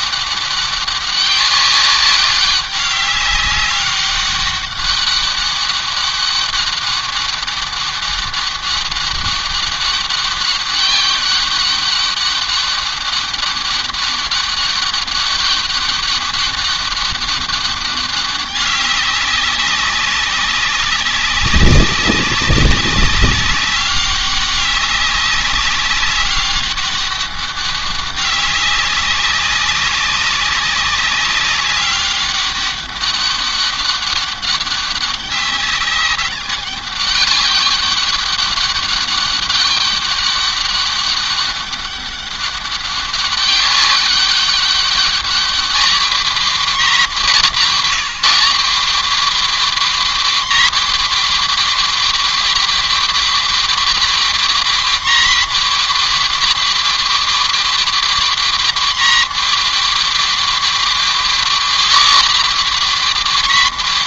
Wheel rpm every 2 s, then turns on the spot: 200, 200, 200, 200, 200, 200, 200, 200, 200, 200, 200, 200, 200, 200, 200, 200, 200, 200, 200, 200, 200, 200, 200, 250, 240, 270, 270, 270, 270, 270, 270, 270.
none